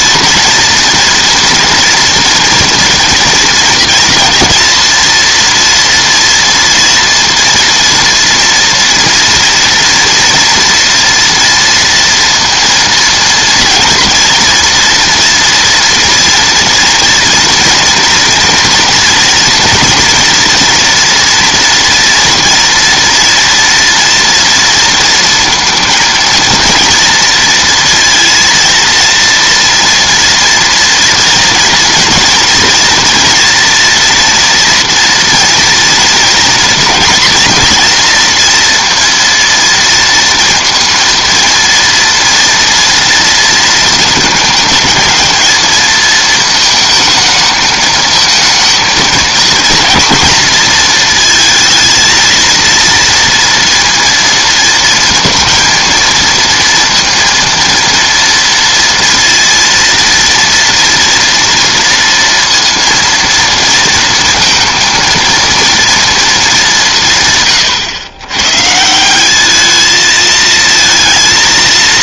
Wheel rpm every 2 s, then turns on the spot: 230, 230, 230, 230, 230, 230, 230, 240, 230, 230, 230, 240, 230, 230, 230, 230, 230, 230, 230, 230, 230, 230, 220, 220, 220, 230, 230, 230, 230, 230, 240, 230, 230, 160, 180, 230.
none